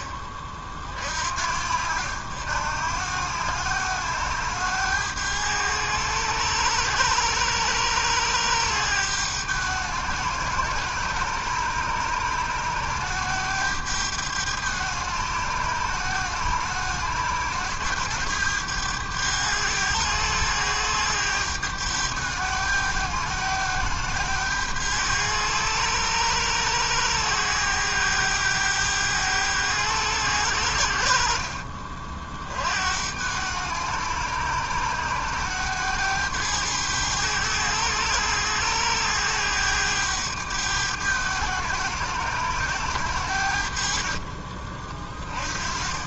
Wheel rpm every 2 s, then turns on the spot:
50, 80, 100, 100, 100, 100, 100, 100, 100, 100, 100, 100, 100, 100, 100, 90, 60, 100, 100, 100, 100, 100, 30.
none